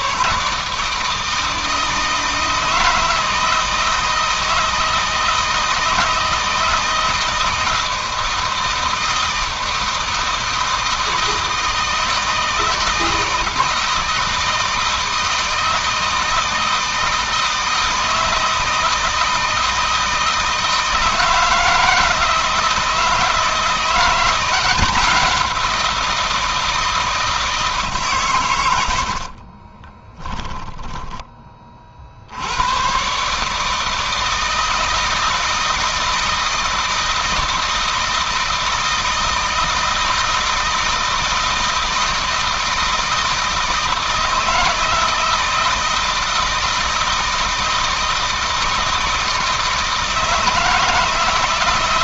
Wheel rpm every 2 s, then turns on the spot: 160, 160, 160, 160, 160, 160, 160, 160, 160, 160, 160, 160, 180, 160, 80, 20, 130, 160, 160, 160, 160, 160, 160, 160, 160, 160.
28-30